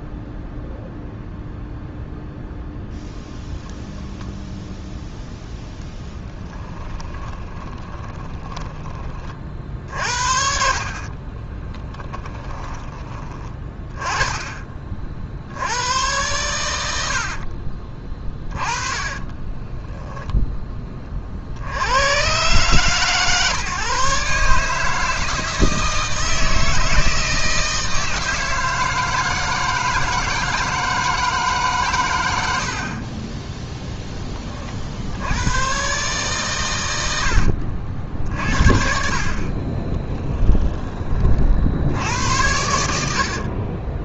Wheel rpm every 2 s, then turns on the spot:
0, 0, 0, 10, 20, 50, 20, 40, 80, 30, 20, 140, 150, 160, 160, 160, 40, 50, 110, 60, 20, 80.
6-8 16-20 42-44